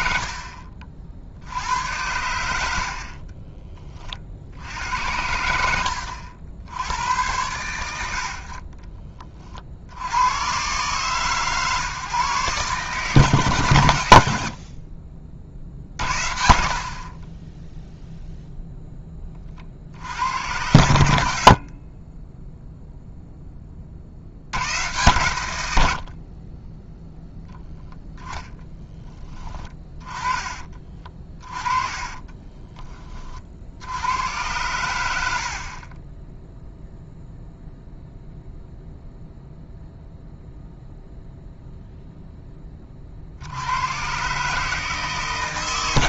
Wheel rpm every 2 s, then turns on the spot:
40, 80, 70, 90, 50, 100, 140, 50, 60, 0, 80, 0, 80, 30, 10, 30, 20, 100, 0, 0, 0, 20, 150.
none